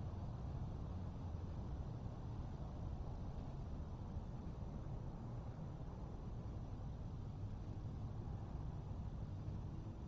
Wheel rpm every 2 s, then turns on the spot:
0, 0, 0, 0, 0.
none